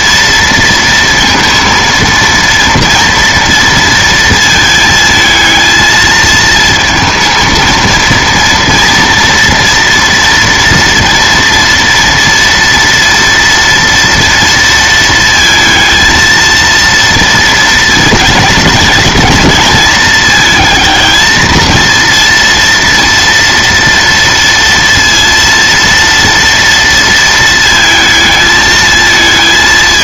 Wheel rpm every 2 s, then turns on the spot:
230, 230, 220, 220, 230, 230, 230, 230, 230, 220, 220, 230, 230, 230, 220.
none